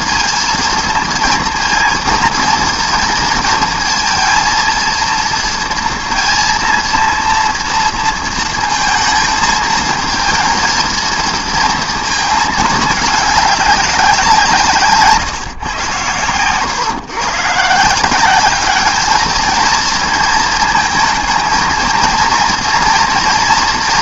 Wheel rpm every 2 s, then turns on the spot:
230, 230, 230, 230, 220, 230, 220, 150, 120, 210, 220, 230.
none